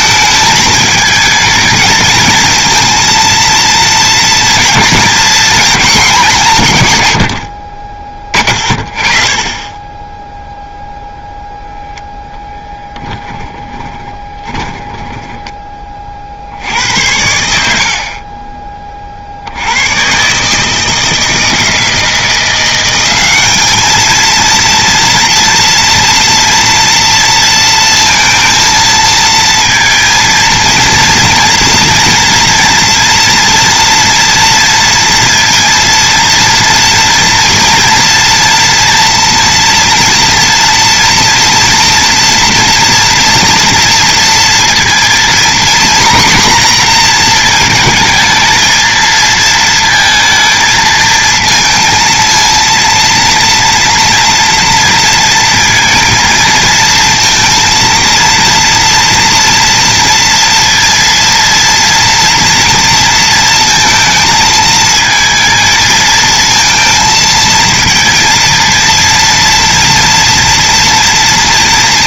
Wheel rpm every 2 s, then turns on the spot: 220, 230, 230, 150, 20, 0, 10, 20, 80, 30, 150, 180, 230, 230, 230, 230, 230, 230, 230, 230, 230, 230, 230, 250, 220, 220, 230, 230, 220, 230, 230, 230, 220, 220, 230, 240.
12-16